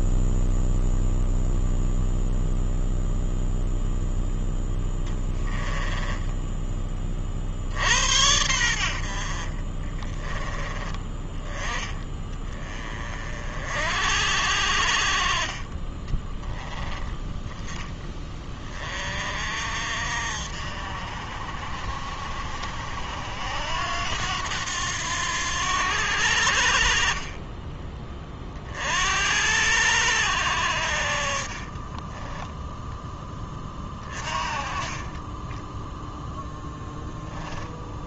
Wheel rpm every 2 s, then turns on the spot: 0, 0, 0, 10, 80, 20, 20, 60, 20, 30, 50, 60, 90, 60, 40, 70, 10, 30, 0.
34-36